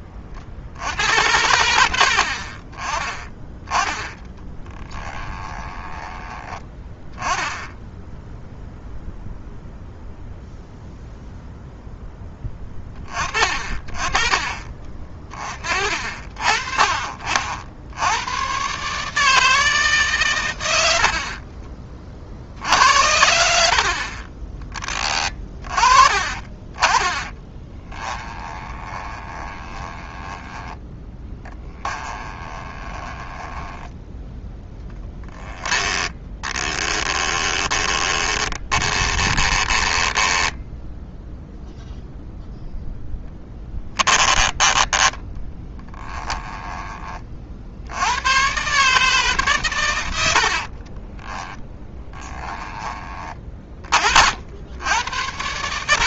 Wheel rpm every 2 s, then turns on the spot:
70, 30, 20, 10, 0, 0, 20, 30, 40, 130, 80, 70, 20, 20, 20, 20, 20, 10, 10, 20, 10, 0, 10, 20, 140, 50, 20, 90.
4-6 24-26 28-42 50-54